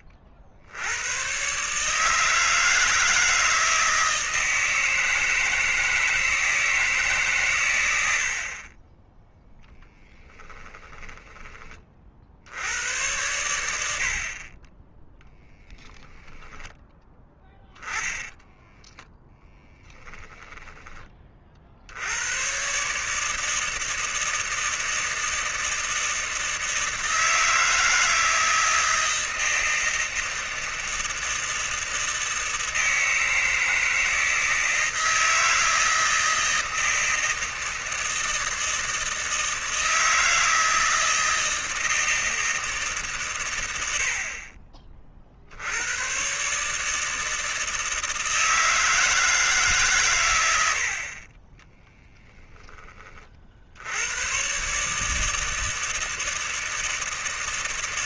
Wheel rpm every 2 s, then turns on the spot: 60, 160, 160, 160, 30, 10, 80, 30, 20, 10, 10, 130, 160, 160, 160, 160, 160, 160, 160, 160, 160, 160, 40, 150, 160, 70, 10, 140, 160.
10-12 16-20